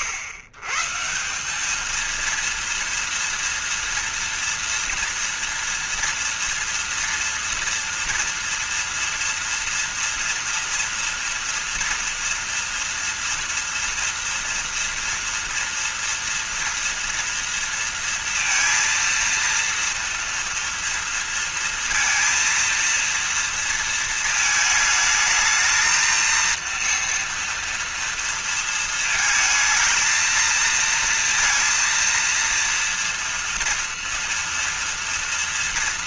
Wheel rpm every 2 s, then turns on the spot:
120, 230, 230, 230, 230, 230, 240, 230, 230, 230, 230, 230, 220, 230, 230, 230, 230, 240.
none